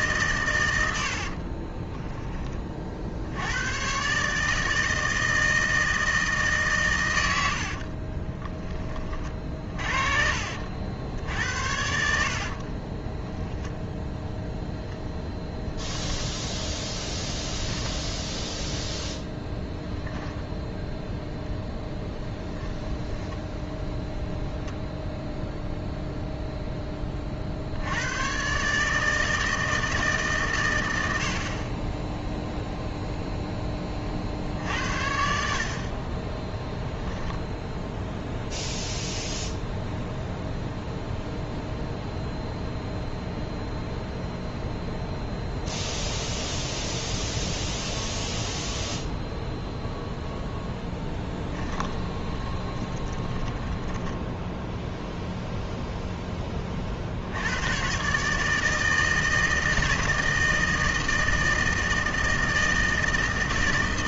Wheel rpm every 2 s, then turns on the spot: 90, 40, 160, 130, 20, 70, 30, 0, 10, 0, 10, 10, 0, 10, 140, 110, 0, 60, 20, 0, 0, 0, 0, 0, 0, 10, 30, 0, 50, 160, 160, 160.
12-14 22-24 50-54